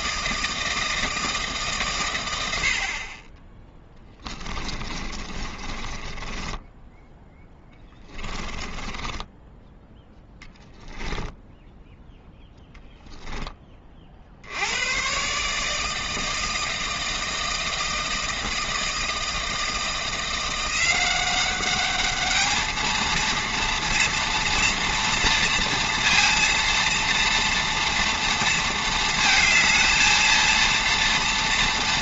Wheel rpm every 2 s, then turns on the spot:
160, 80, 20, 10, 20, 10, 10, 80, 160, 160, 180, 220, 230, 230, 230, 230.
4-10